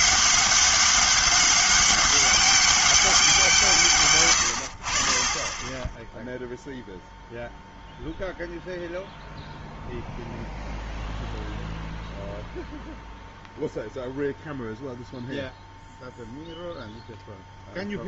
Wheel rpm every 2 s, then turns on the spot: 200, 190, 90, 0, 0, 0, 0, 0, 0.
none